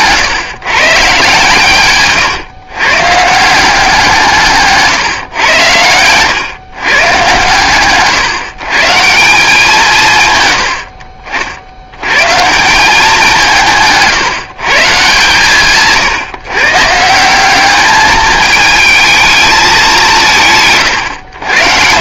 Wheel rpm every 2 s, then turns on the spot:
140, 130, 140, 130, 150, 70, 180, 150, 140, 220, 150.
none